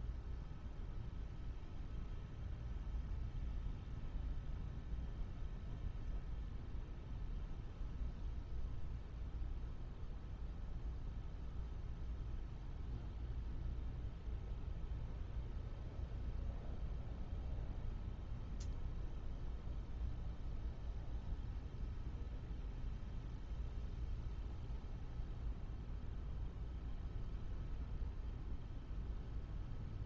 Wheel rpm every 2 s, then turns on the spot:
0, 0, 0, 0, 0, 0, 0, 0, 0, 0, 0, 0, 0, 0, 0.
none